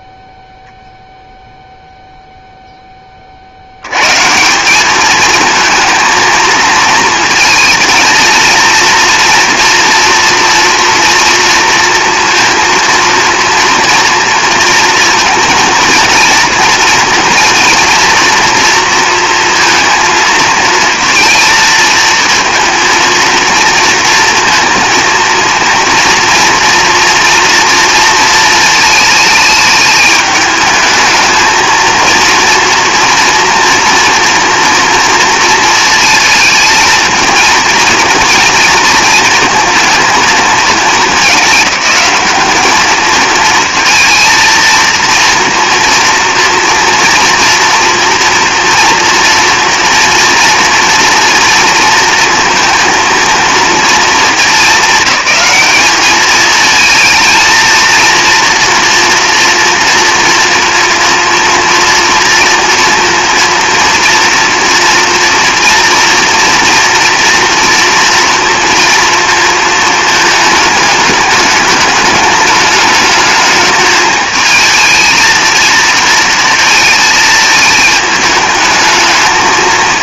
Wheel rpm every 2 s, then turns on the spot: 0, 10, 200, 230, 230, 230, 230, 230, 230, 230, 220, 230, 230, 230, 220, 220, 230, 230, 220, 230, 210, 210, 230, 240, 230, 230, 230, 210, 220, 230, 230, 240, 230, 230, 230, 220, 210, 220, 230, 210.
none